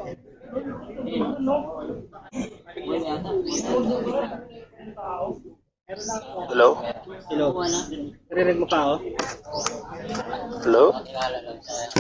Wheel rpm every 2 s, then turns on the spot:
0, 0, 0, 0, 0, 0.
none